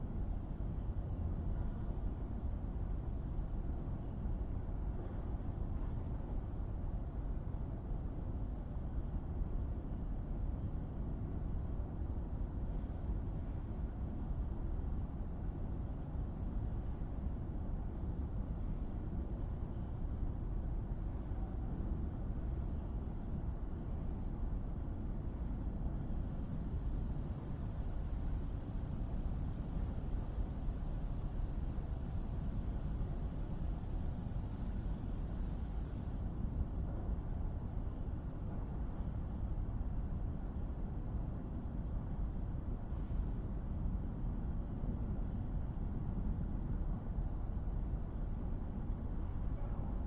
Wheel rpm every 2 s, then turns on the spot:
0, 0, 0, 0, 0, 0, 0, 0, 0, 0, 0, 0, 0, 0, 0, 0, 0, 0, 0, 0, 0, 0, 0, 0, 0.
none